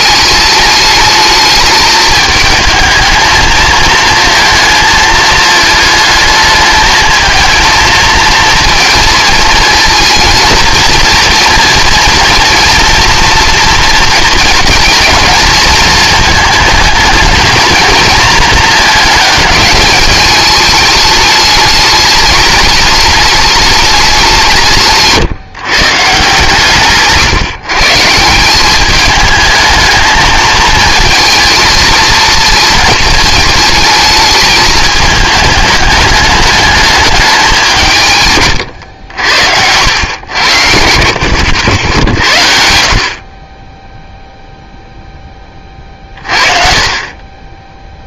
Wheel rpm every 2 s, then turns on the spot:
210, 220, 220, 220, 230, 230, 230, 230, 220, 220, 210, 220, 160, 140, 200, 220, 230, 210, 210, 110, 70, 60, 0, 40.
40-42